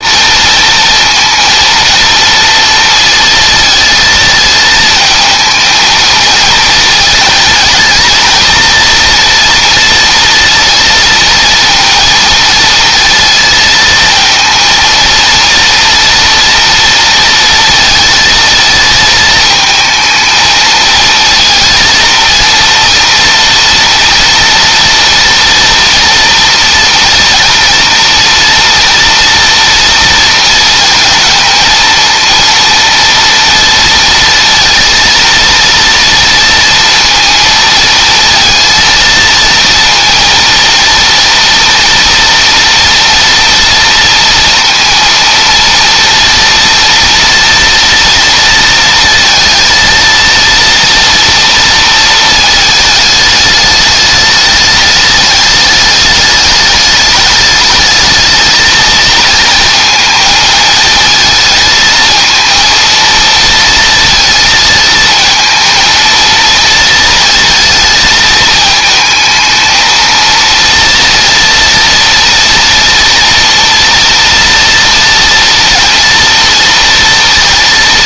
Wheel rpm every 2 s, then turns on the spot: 230, 230, 220, 230, 230, 230, 230, 230, 230, 220, 220, 230, 230, 230, 230, 220, 230, 230, 230, 230, 230, 230, 230, 230, 230, 230, 220, 210, 210, 220, 220, 230, 230, 220, 220, 230, 230, 240, 230.
none